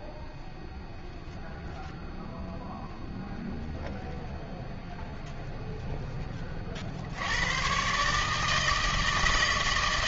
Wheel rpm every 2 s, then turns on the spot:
0, 0, 0, 130, 160.
none